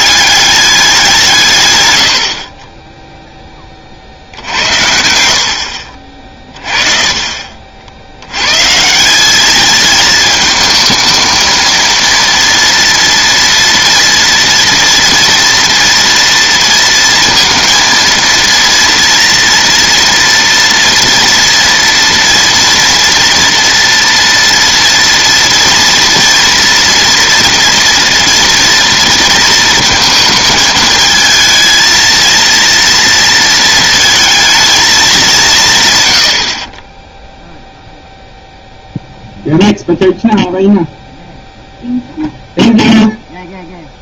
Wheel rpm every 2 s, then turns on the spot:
180, 20, 70, 30, 170, 220, 230, 230, 230, 230, 230, 230, 230, 230, 230, 220, 230, 210, 20, 0, 0, 0.
none